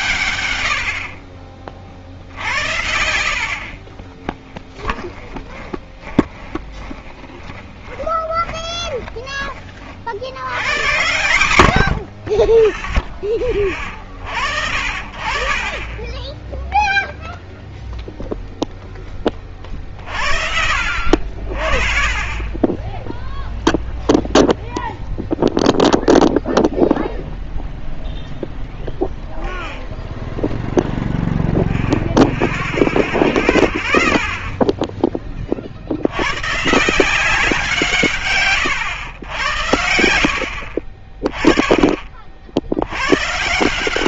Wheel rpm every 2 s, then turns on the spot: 90, 80, 10, 20, 20, 90, 20, 50, 10, 0, 60, 10, 0, 0, 0, 0, 0, 10, 150, 120, 50, 70.
4-10